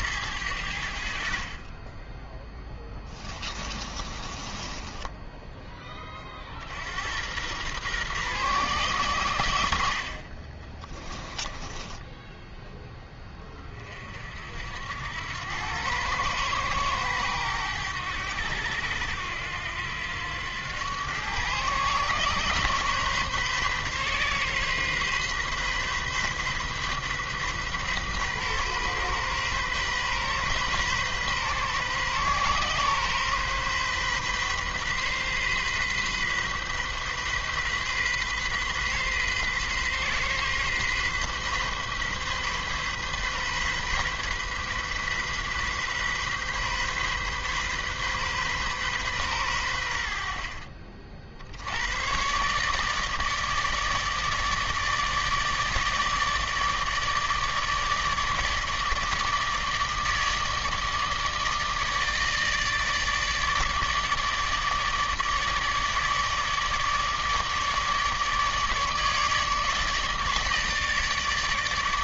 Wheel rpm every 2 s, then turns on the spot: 70, 10, 10, 80, 110, 20, 10, 80, 110, 80, 110, 140, 130, 130, 130, 130, 130, 130, 130, 130, 130, 130, 130, 130, 130, 50, 150, 150, 150, 150, 150, 150, 150, 150, 150, 150.
2-6 10-12